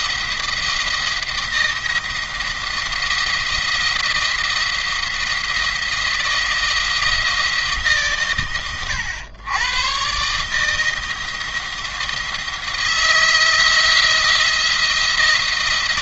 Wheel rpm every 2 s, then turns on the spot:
170, 170, 170, 170, 110, 160, 160, 170.
none